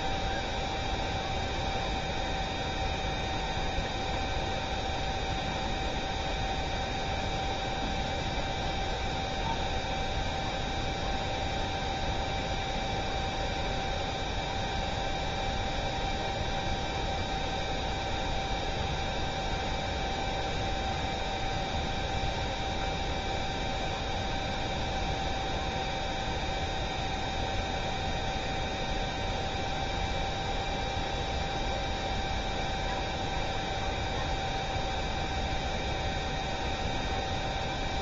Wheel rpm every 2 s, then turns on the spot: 0, 0, 0, 0, 0, 0, 0, 0, 0, 0, 0, 0, 0, 0, 0, 0, 0, 0, 0.
none